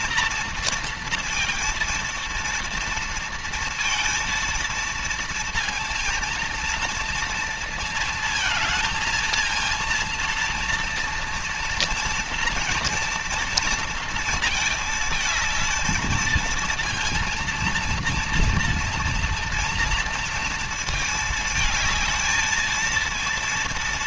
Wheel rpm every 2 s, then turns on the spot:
230, 230, 230, 230, 220, 230, 230, 220, 230, 230, 220, 220.
none